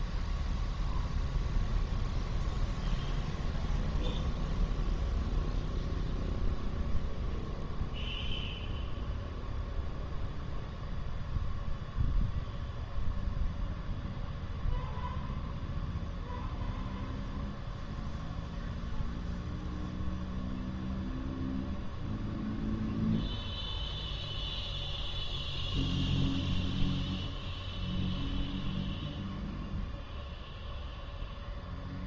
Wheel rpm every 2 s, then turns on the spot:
0, 0, 0, 0, 0, 0, 0, 0, 0, 0, 0, 0, 0, 0, 0, 0.
none